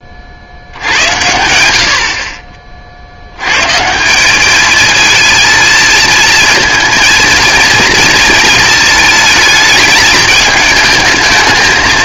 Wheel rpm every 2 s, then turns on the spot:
80, 40, 220, 220, 230, 220.
none